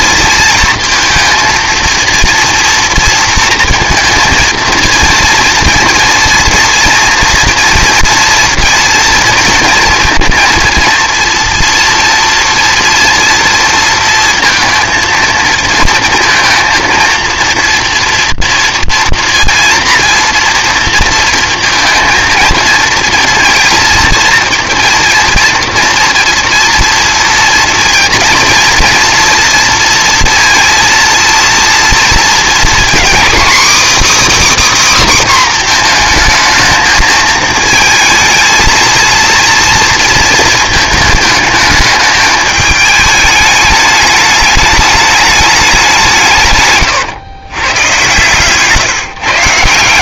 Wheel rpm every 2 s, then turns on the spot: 230, 230, 230, 230, 240, 230, 230, 220, 230, 230, 230, 230, 230, 230, 230, 230, 260, 290, 220, 230, 220, 210, 210, 130, 150.
none